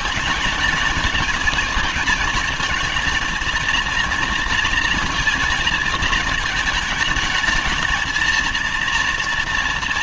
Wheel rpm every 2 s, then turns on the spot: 220, 220, 230, 220, 230.
none